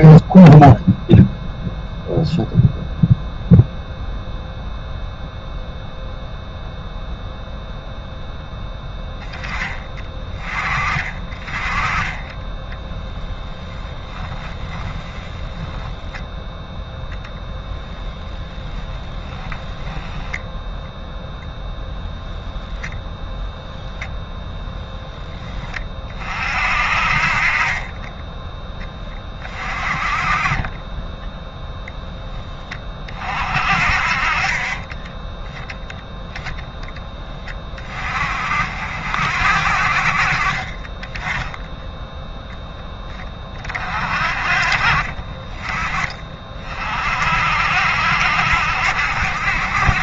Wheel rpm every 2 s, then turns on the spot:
0, 0, 0, 0, 0, 20, 10, 10, 0, 10, 0, 10, 10, 50, 10, 20, 20, 30, 0, 50, 30, 10, 30, 40, 70.
12-14 30-32 44-46